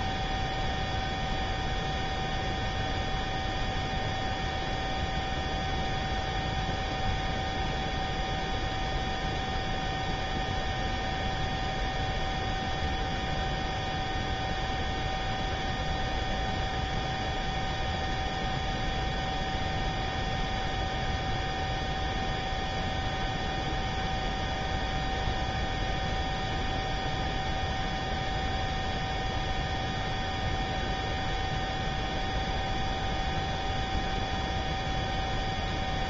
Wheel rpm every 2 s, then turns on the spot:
0, 0, 0, 0, 0, 0, 0, 0, 0, 0, 0, 0, 0, 0, 0, 0, 0, 0.
none